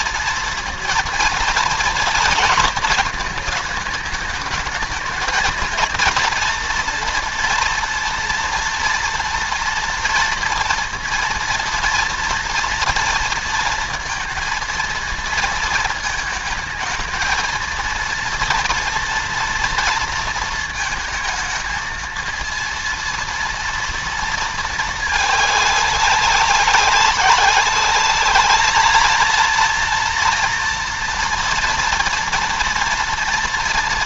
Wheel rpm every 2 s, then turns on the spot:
230, 220, 220, 240, 240, 230, 230, 230, 220, 230, 230, 230, 220, 190, 220, 230, 230.
none